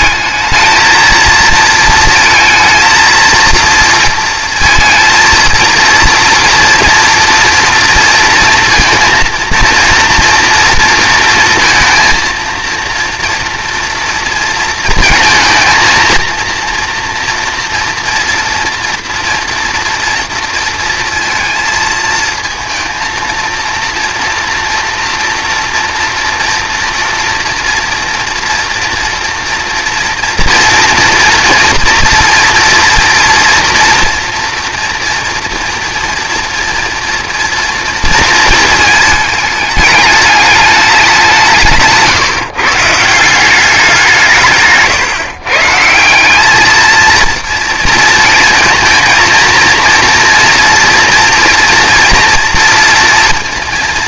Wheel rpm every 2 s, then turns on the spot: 220, 230, 230, 230, 230, 230, 230, 230, 230, 230, 230, 230, 230, 230, 230, 230, 230, 240, 230, 220, 210, 150, 150, 220, 220, 230, 230.
44-46